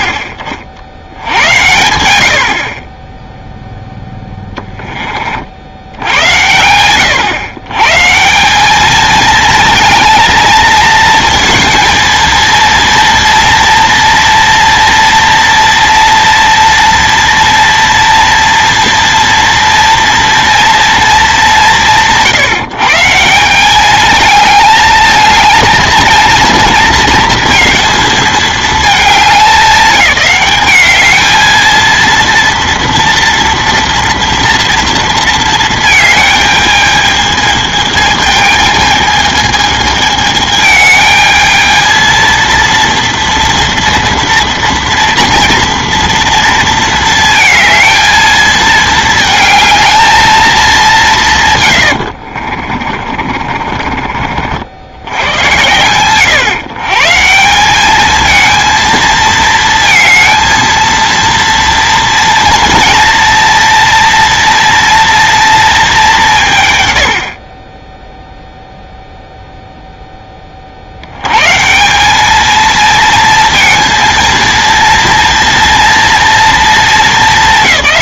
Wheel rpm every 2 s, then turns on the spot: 70, 50, 10, 100, 190, 230, 230, 230, 230, 230, 230, 150, 220, 230, 220, 210, 230, 230, 220, 220, 220, 230, 230, 230, 220, 210, 40, 60, 140, 220, 230, 230, 240, 110, 0, 30, 220, 230, 230.
52-54